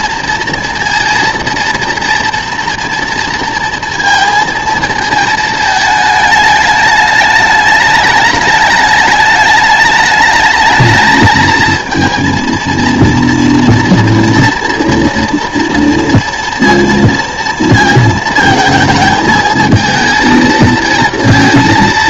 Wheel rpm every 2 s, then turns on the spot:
230, 230, 230, 210, 210, 210, 230, 230, 230, 220, 220.
none